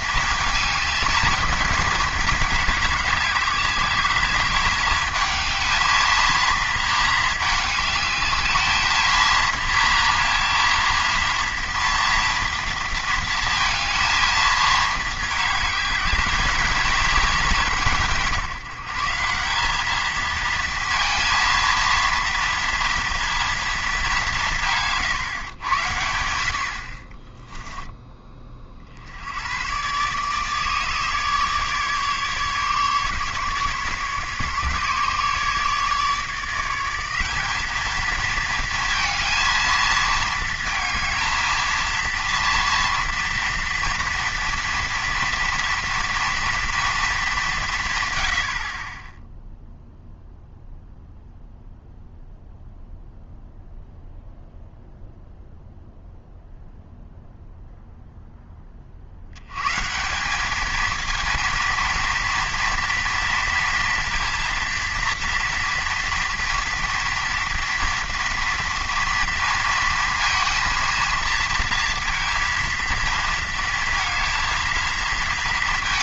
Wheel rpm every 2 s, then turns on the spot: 220, 210, 200, 230, 220, 230, 230, 220, 220, 160, 220, 230, 180, 60, 40, 150, 150, 150, 170, 230, 220, 230, 230, 230, 70, 0, 0, 0, 0, 20, 210, 230, 230, 230, 240, 230, 230, 230.
none